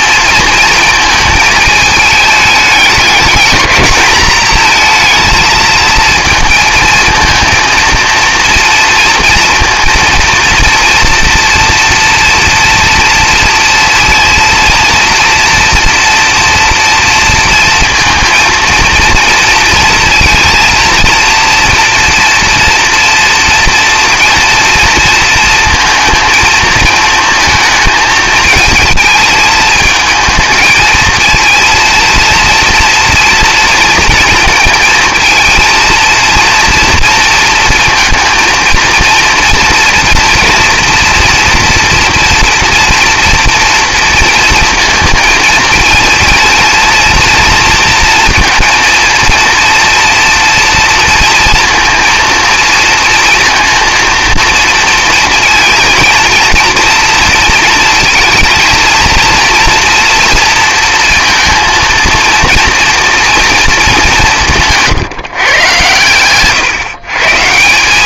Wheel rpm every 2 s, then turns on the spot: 220, 210, 230, 220, 230, 230, 230, 230, 230, 230, 230, 240, 230, 220, 220, 220, 230, 230, 230, 230, 230, 230, 230, 230, 230, 240, 230, 230, 230, 230, 230, 230, 170, 130.
none